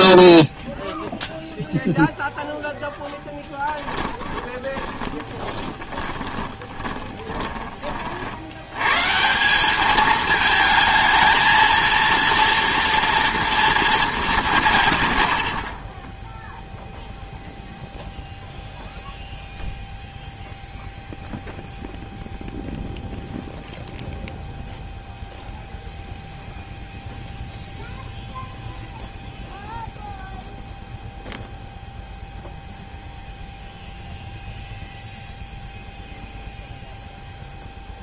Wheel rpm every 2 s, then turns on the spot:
0, 0, 20, 20, 90, 220, 230, 120, 0, 0, 0, 0, 0, 0, 0, 0, 0, 0, 0.
4-8